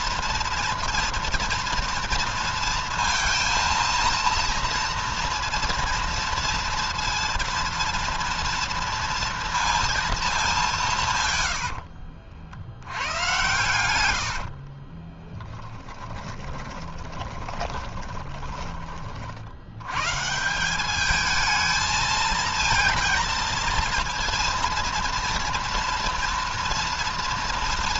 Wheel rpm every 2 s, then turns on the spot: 230, 230, 230, 230, 230, 160, 90, 30, 20, 40, 200, 230, 230, 230.
14-18